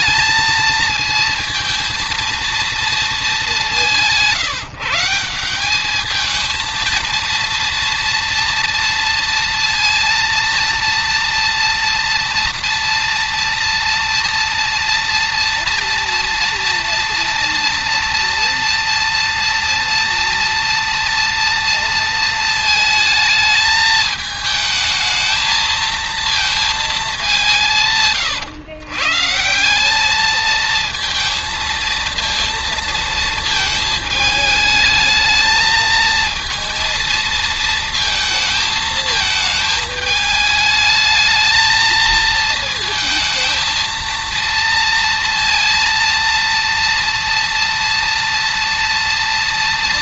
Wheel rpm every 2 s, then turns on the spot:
220, 220, 160, 230, 230, 230, 230, 230, 230, 230, 230, 220, 220, 210, 130, 220, 230, 220, 230, 220, 220, 220, 230, 230, 230.
none